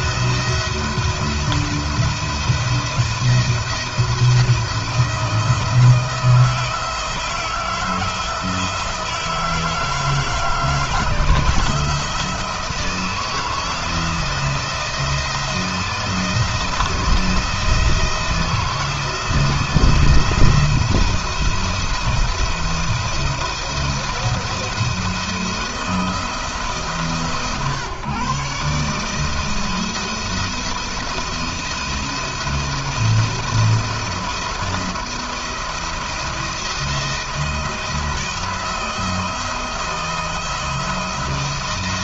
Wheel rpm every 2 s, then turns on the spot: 170, 170, 170, 170, 160, 160, 170, 170, 160, 160, 170, 170, 170, 160, 150, 170, 170, 170, 170, 170, 170.
none